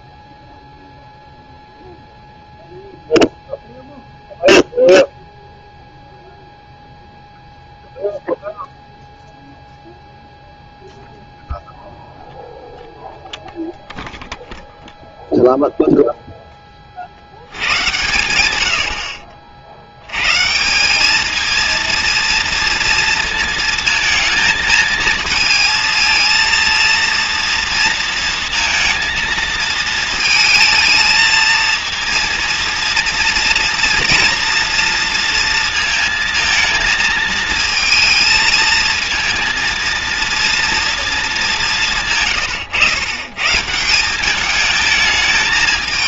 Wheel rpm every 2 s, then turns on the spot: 20, 0, 0, 0, 0, 0, 0, 0, 40, 70, 200, 230, 220, 230, 230, 220, 220, 230, 220, 230, 230, 110, 220.
18-20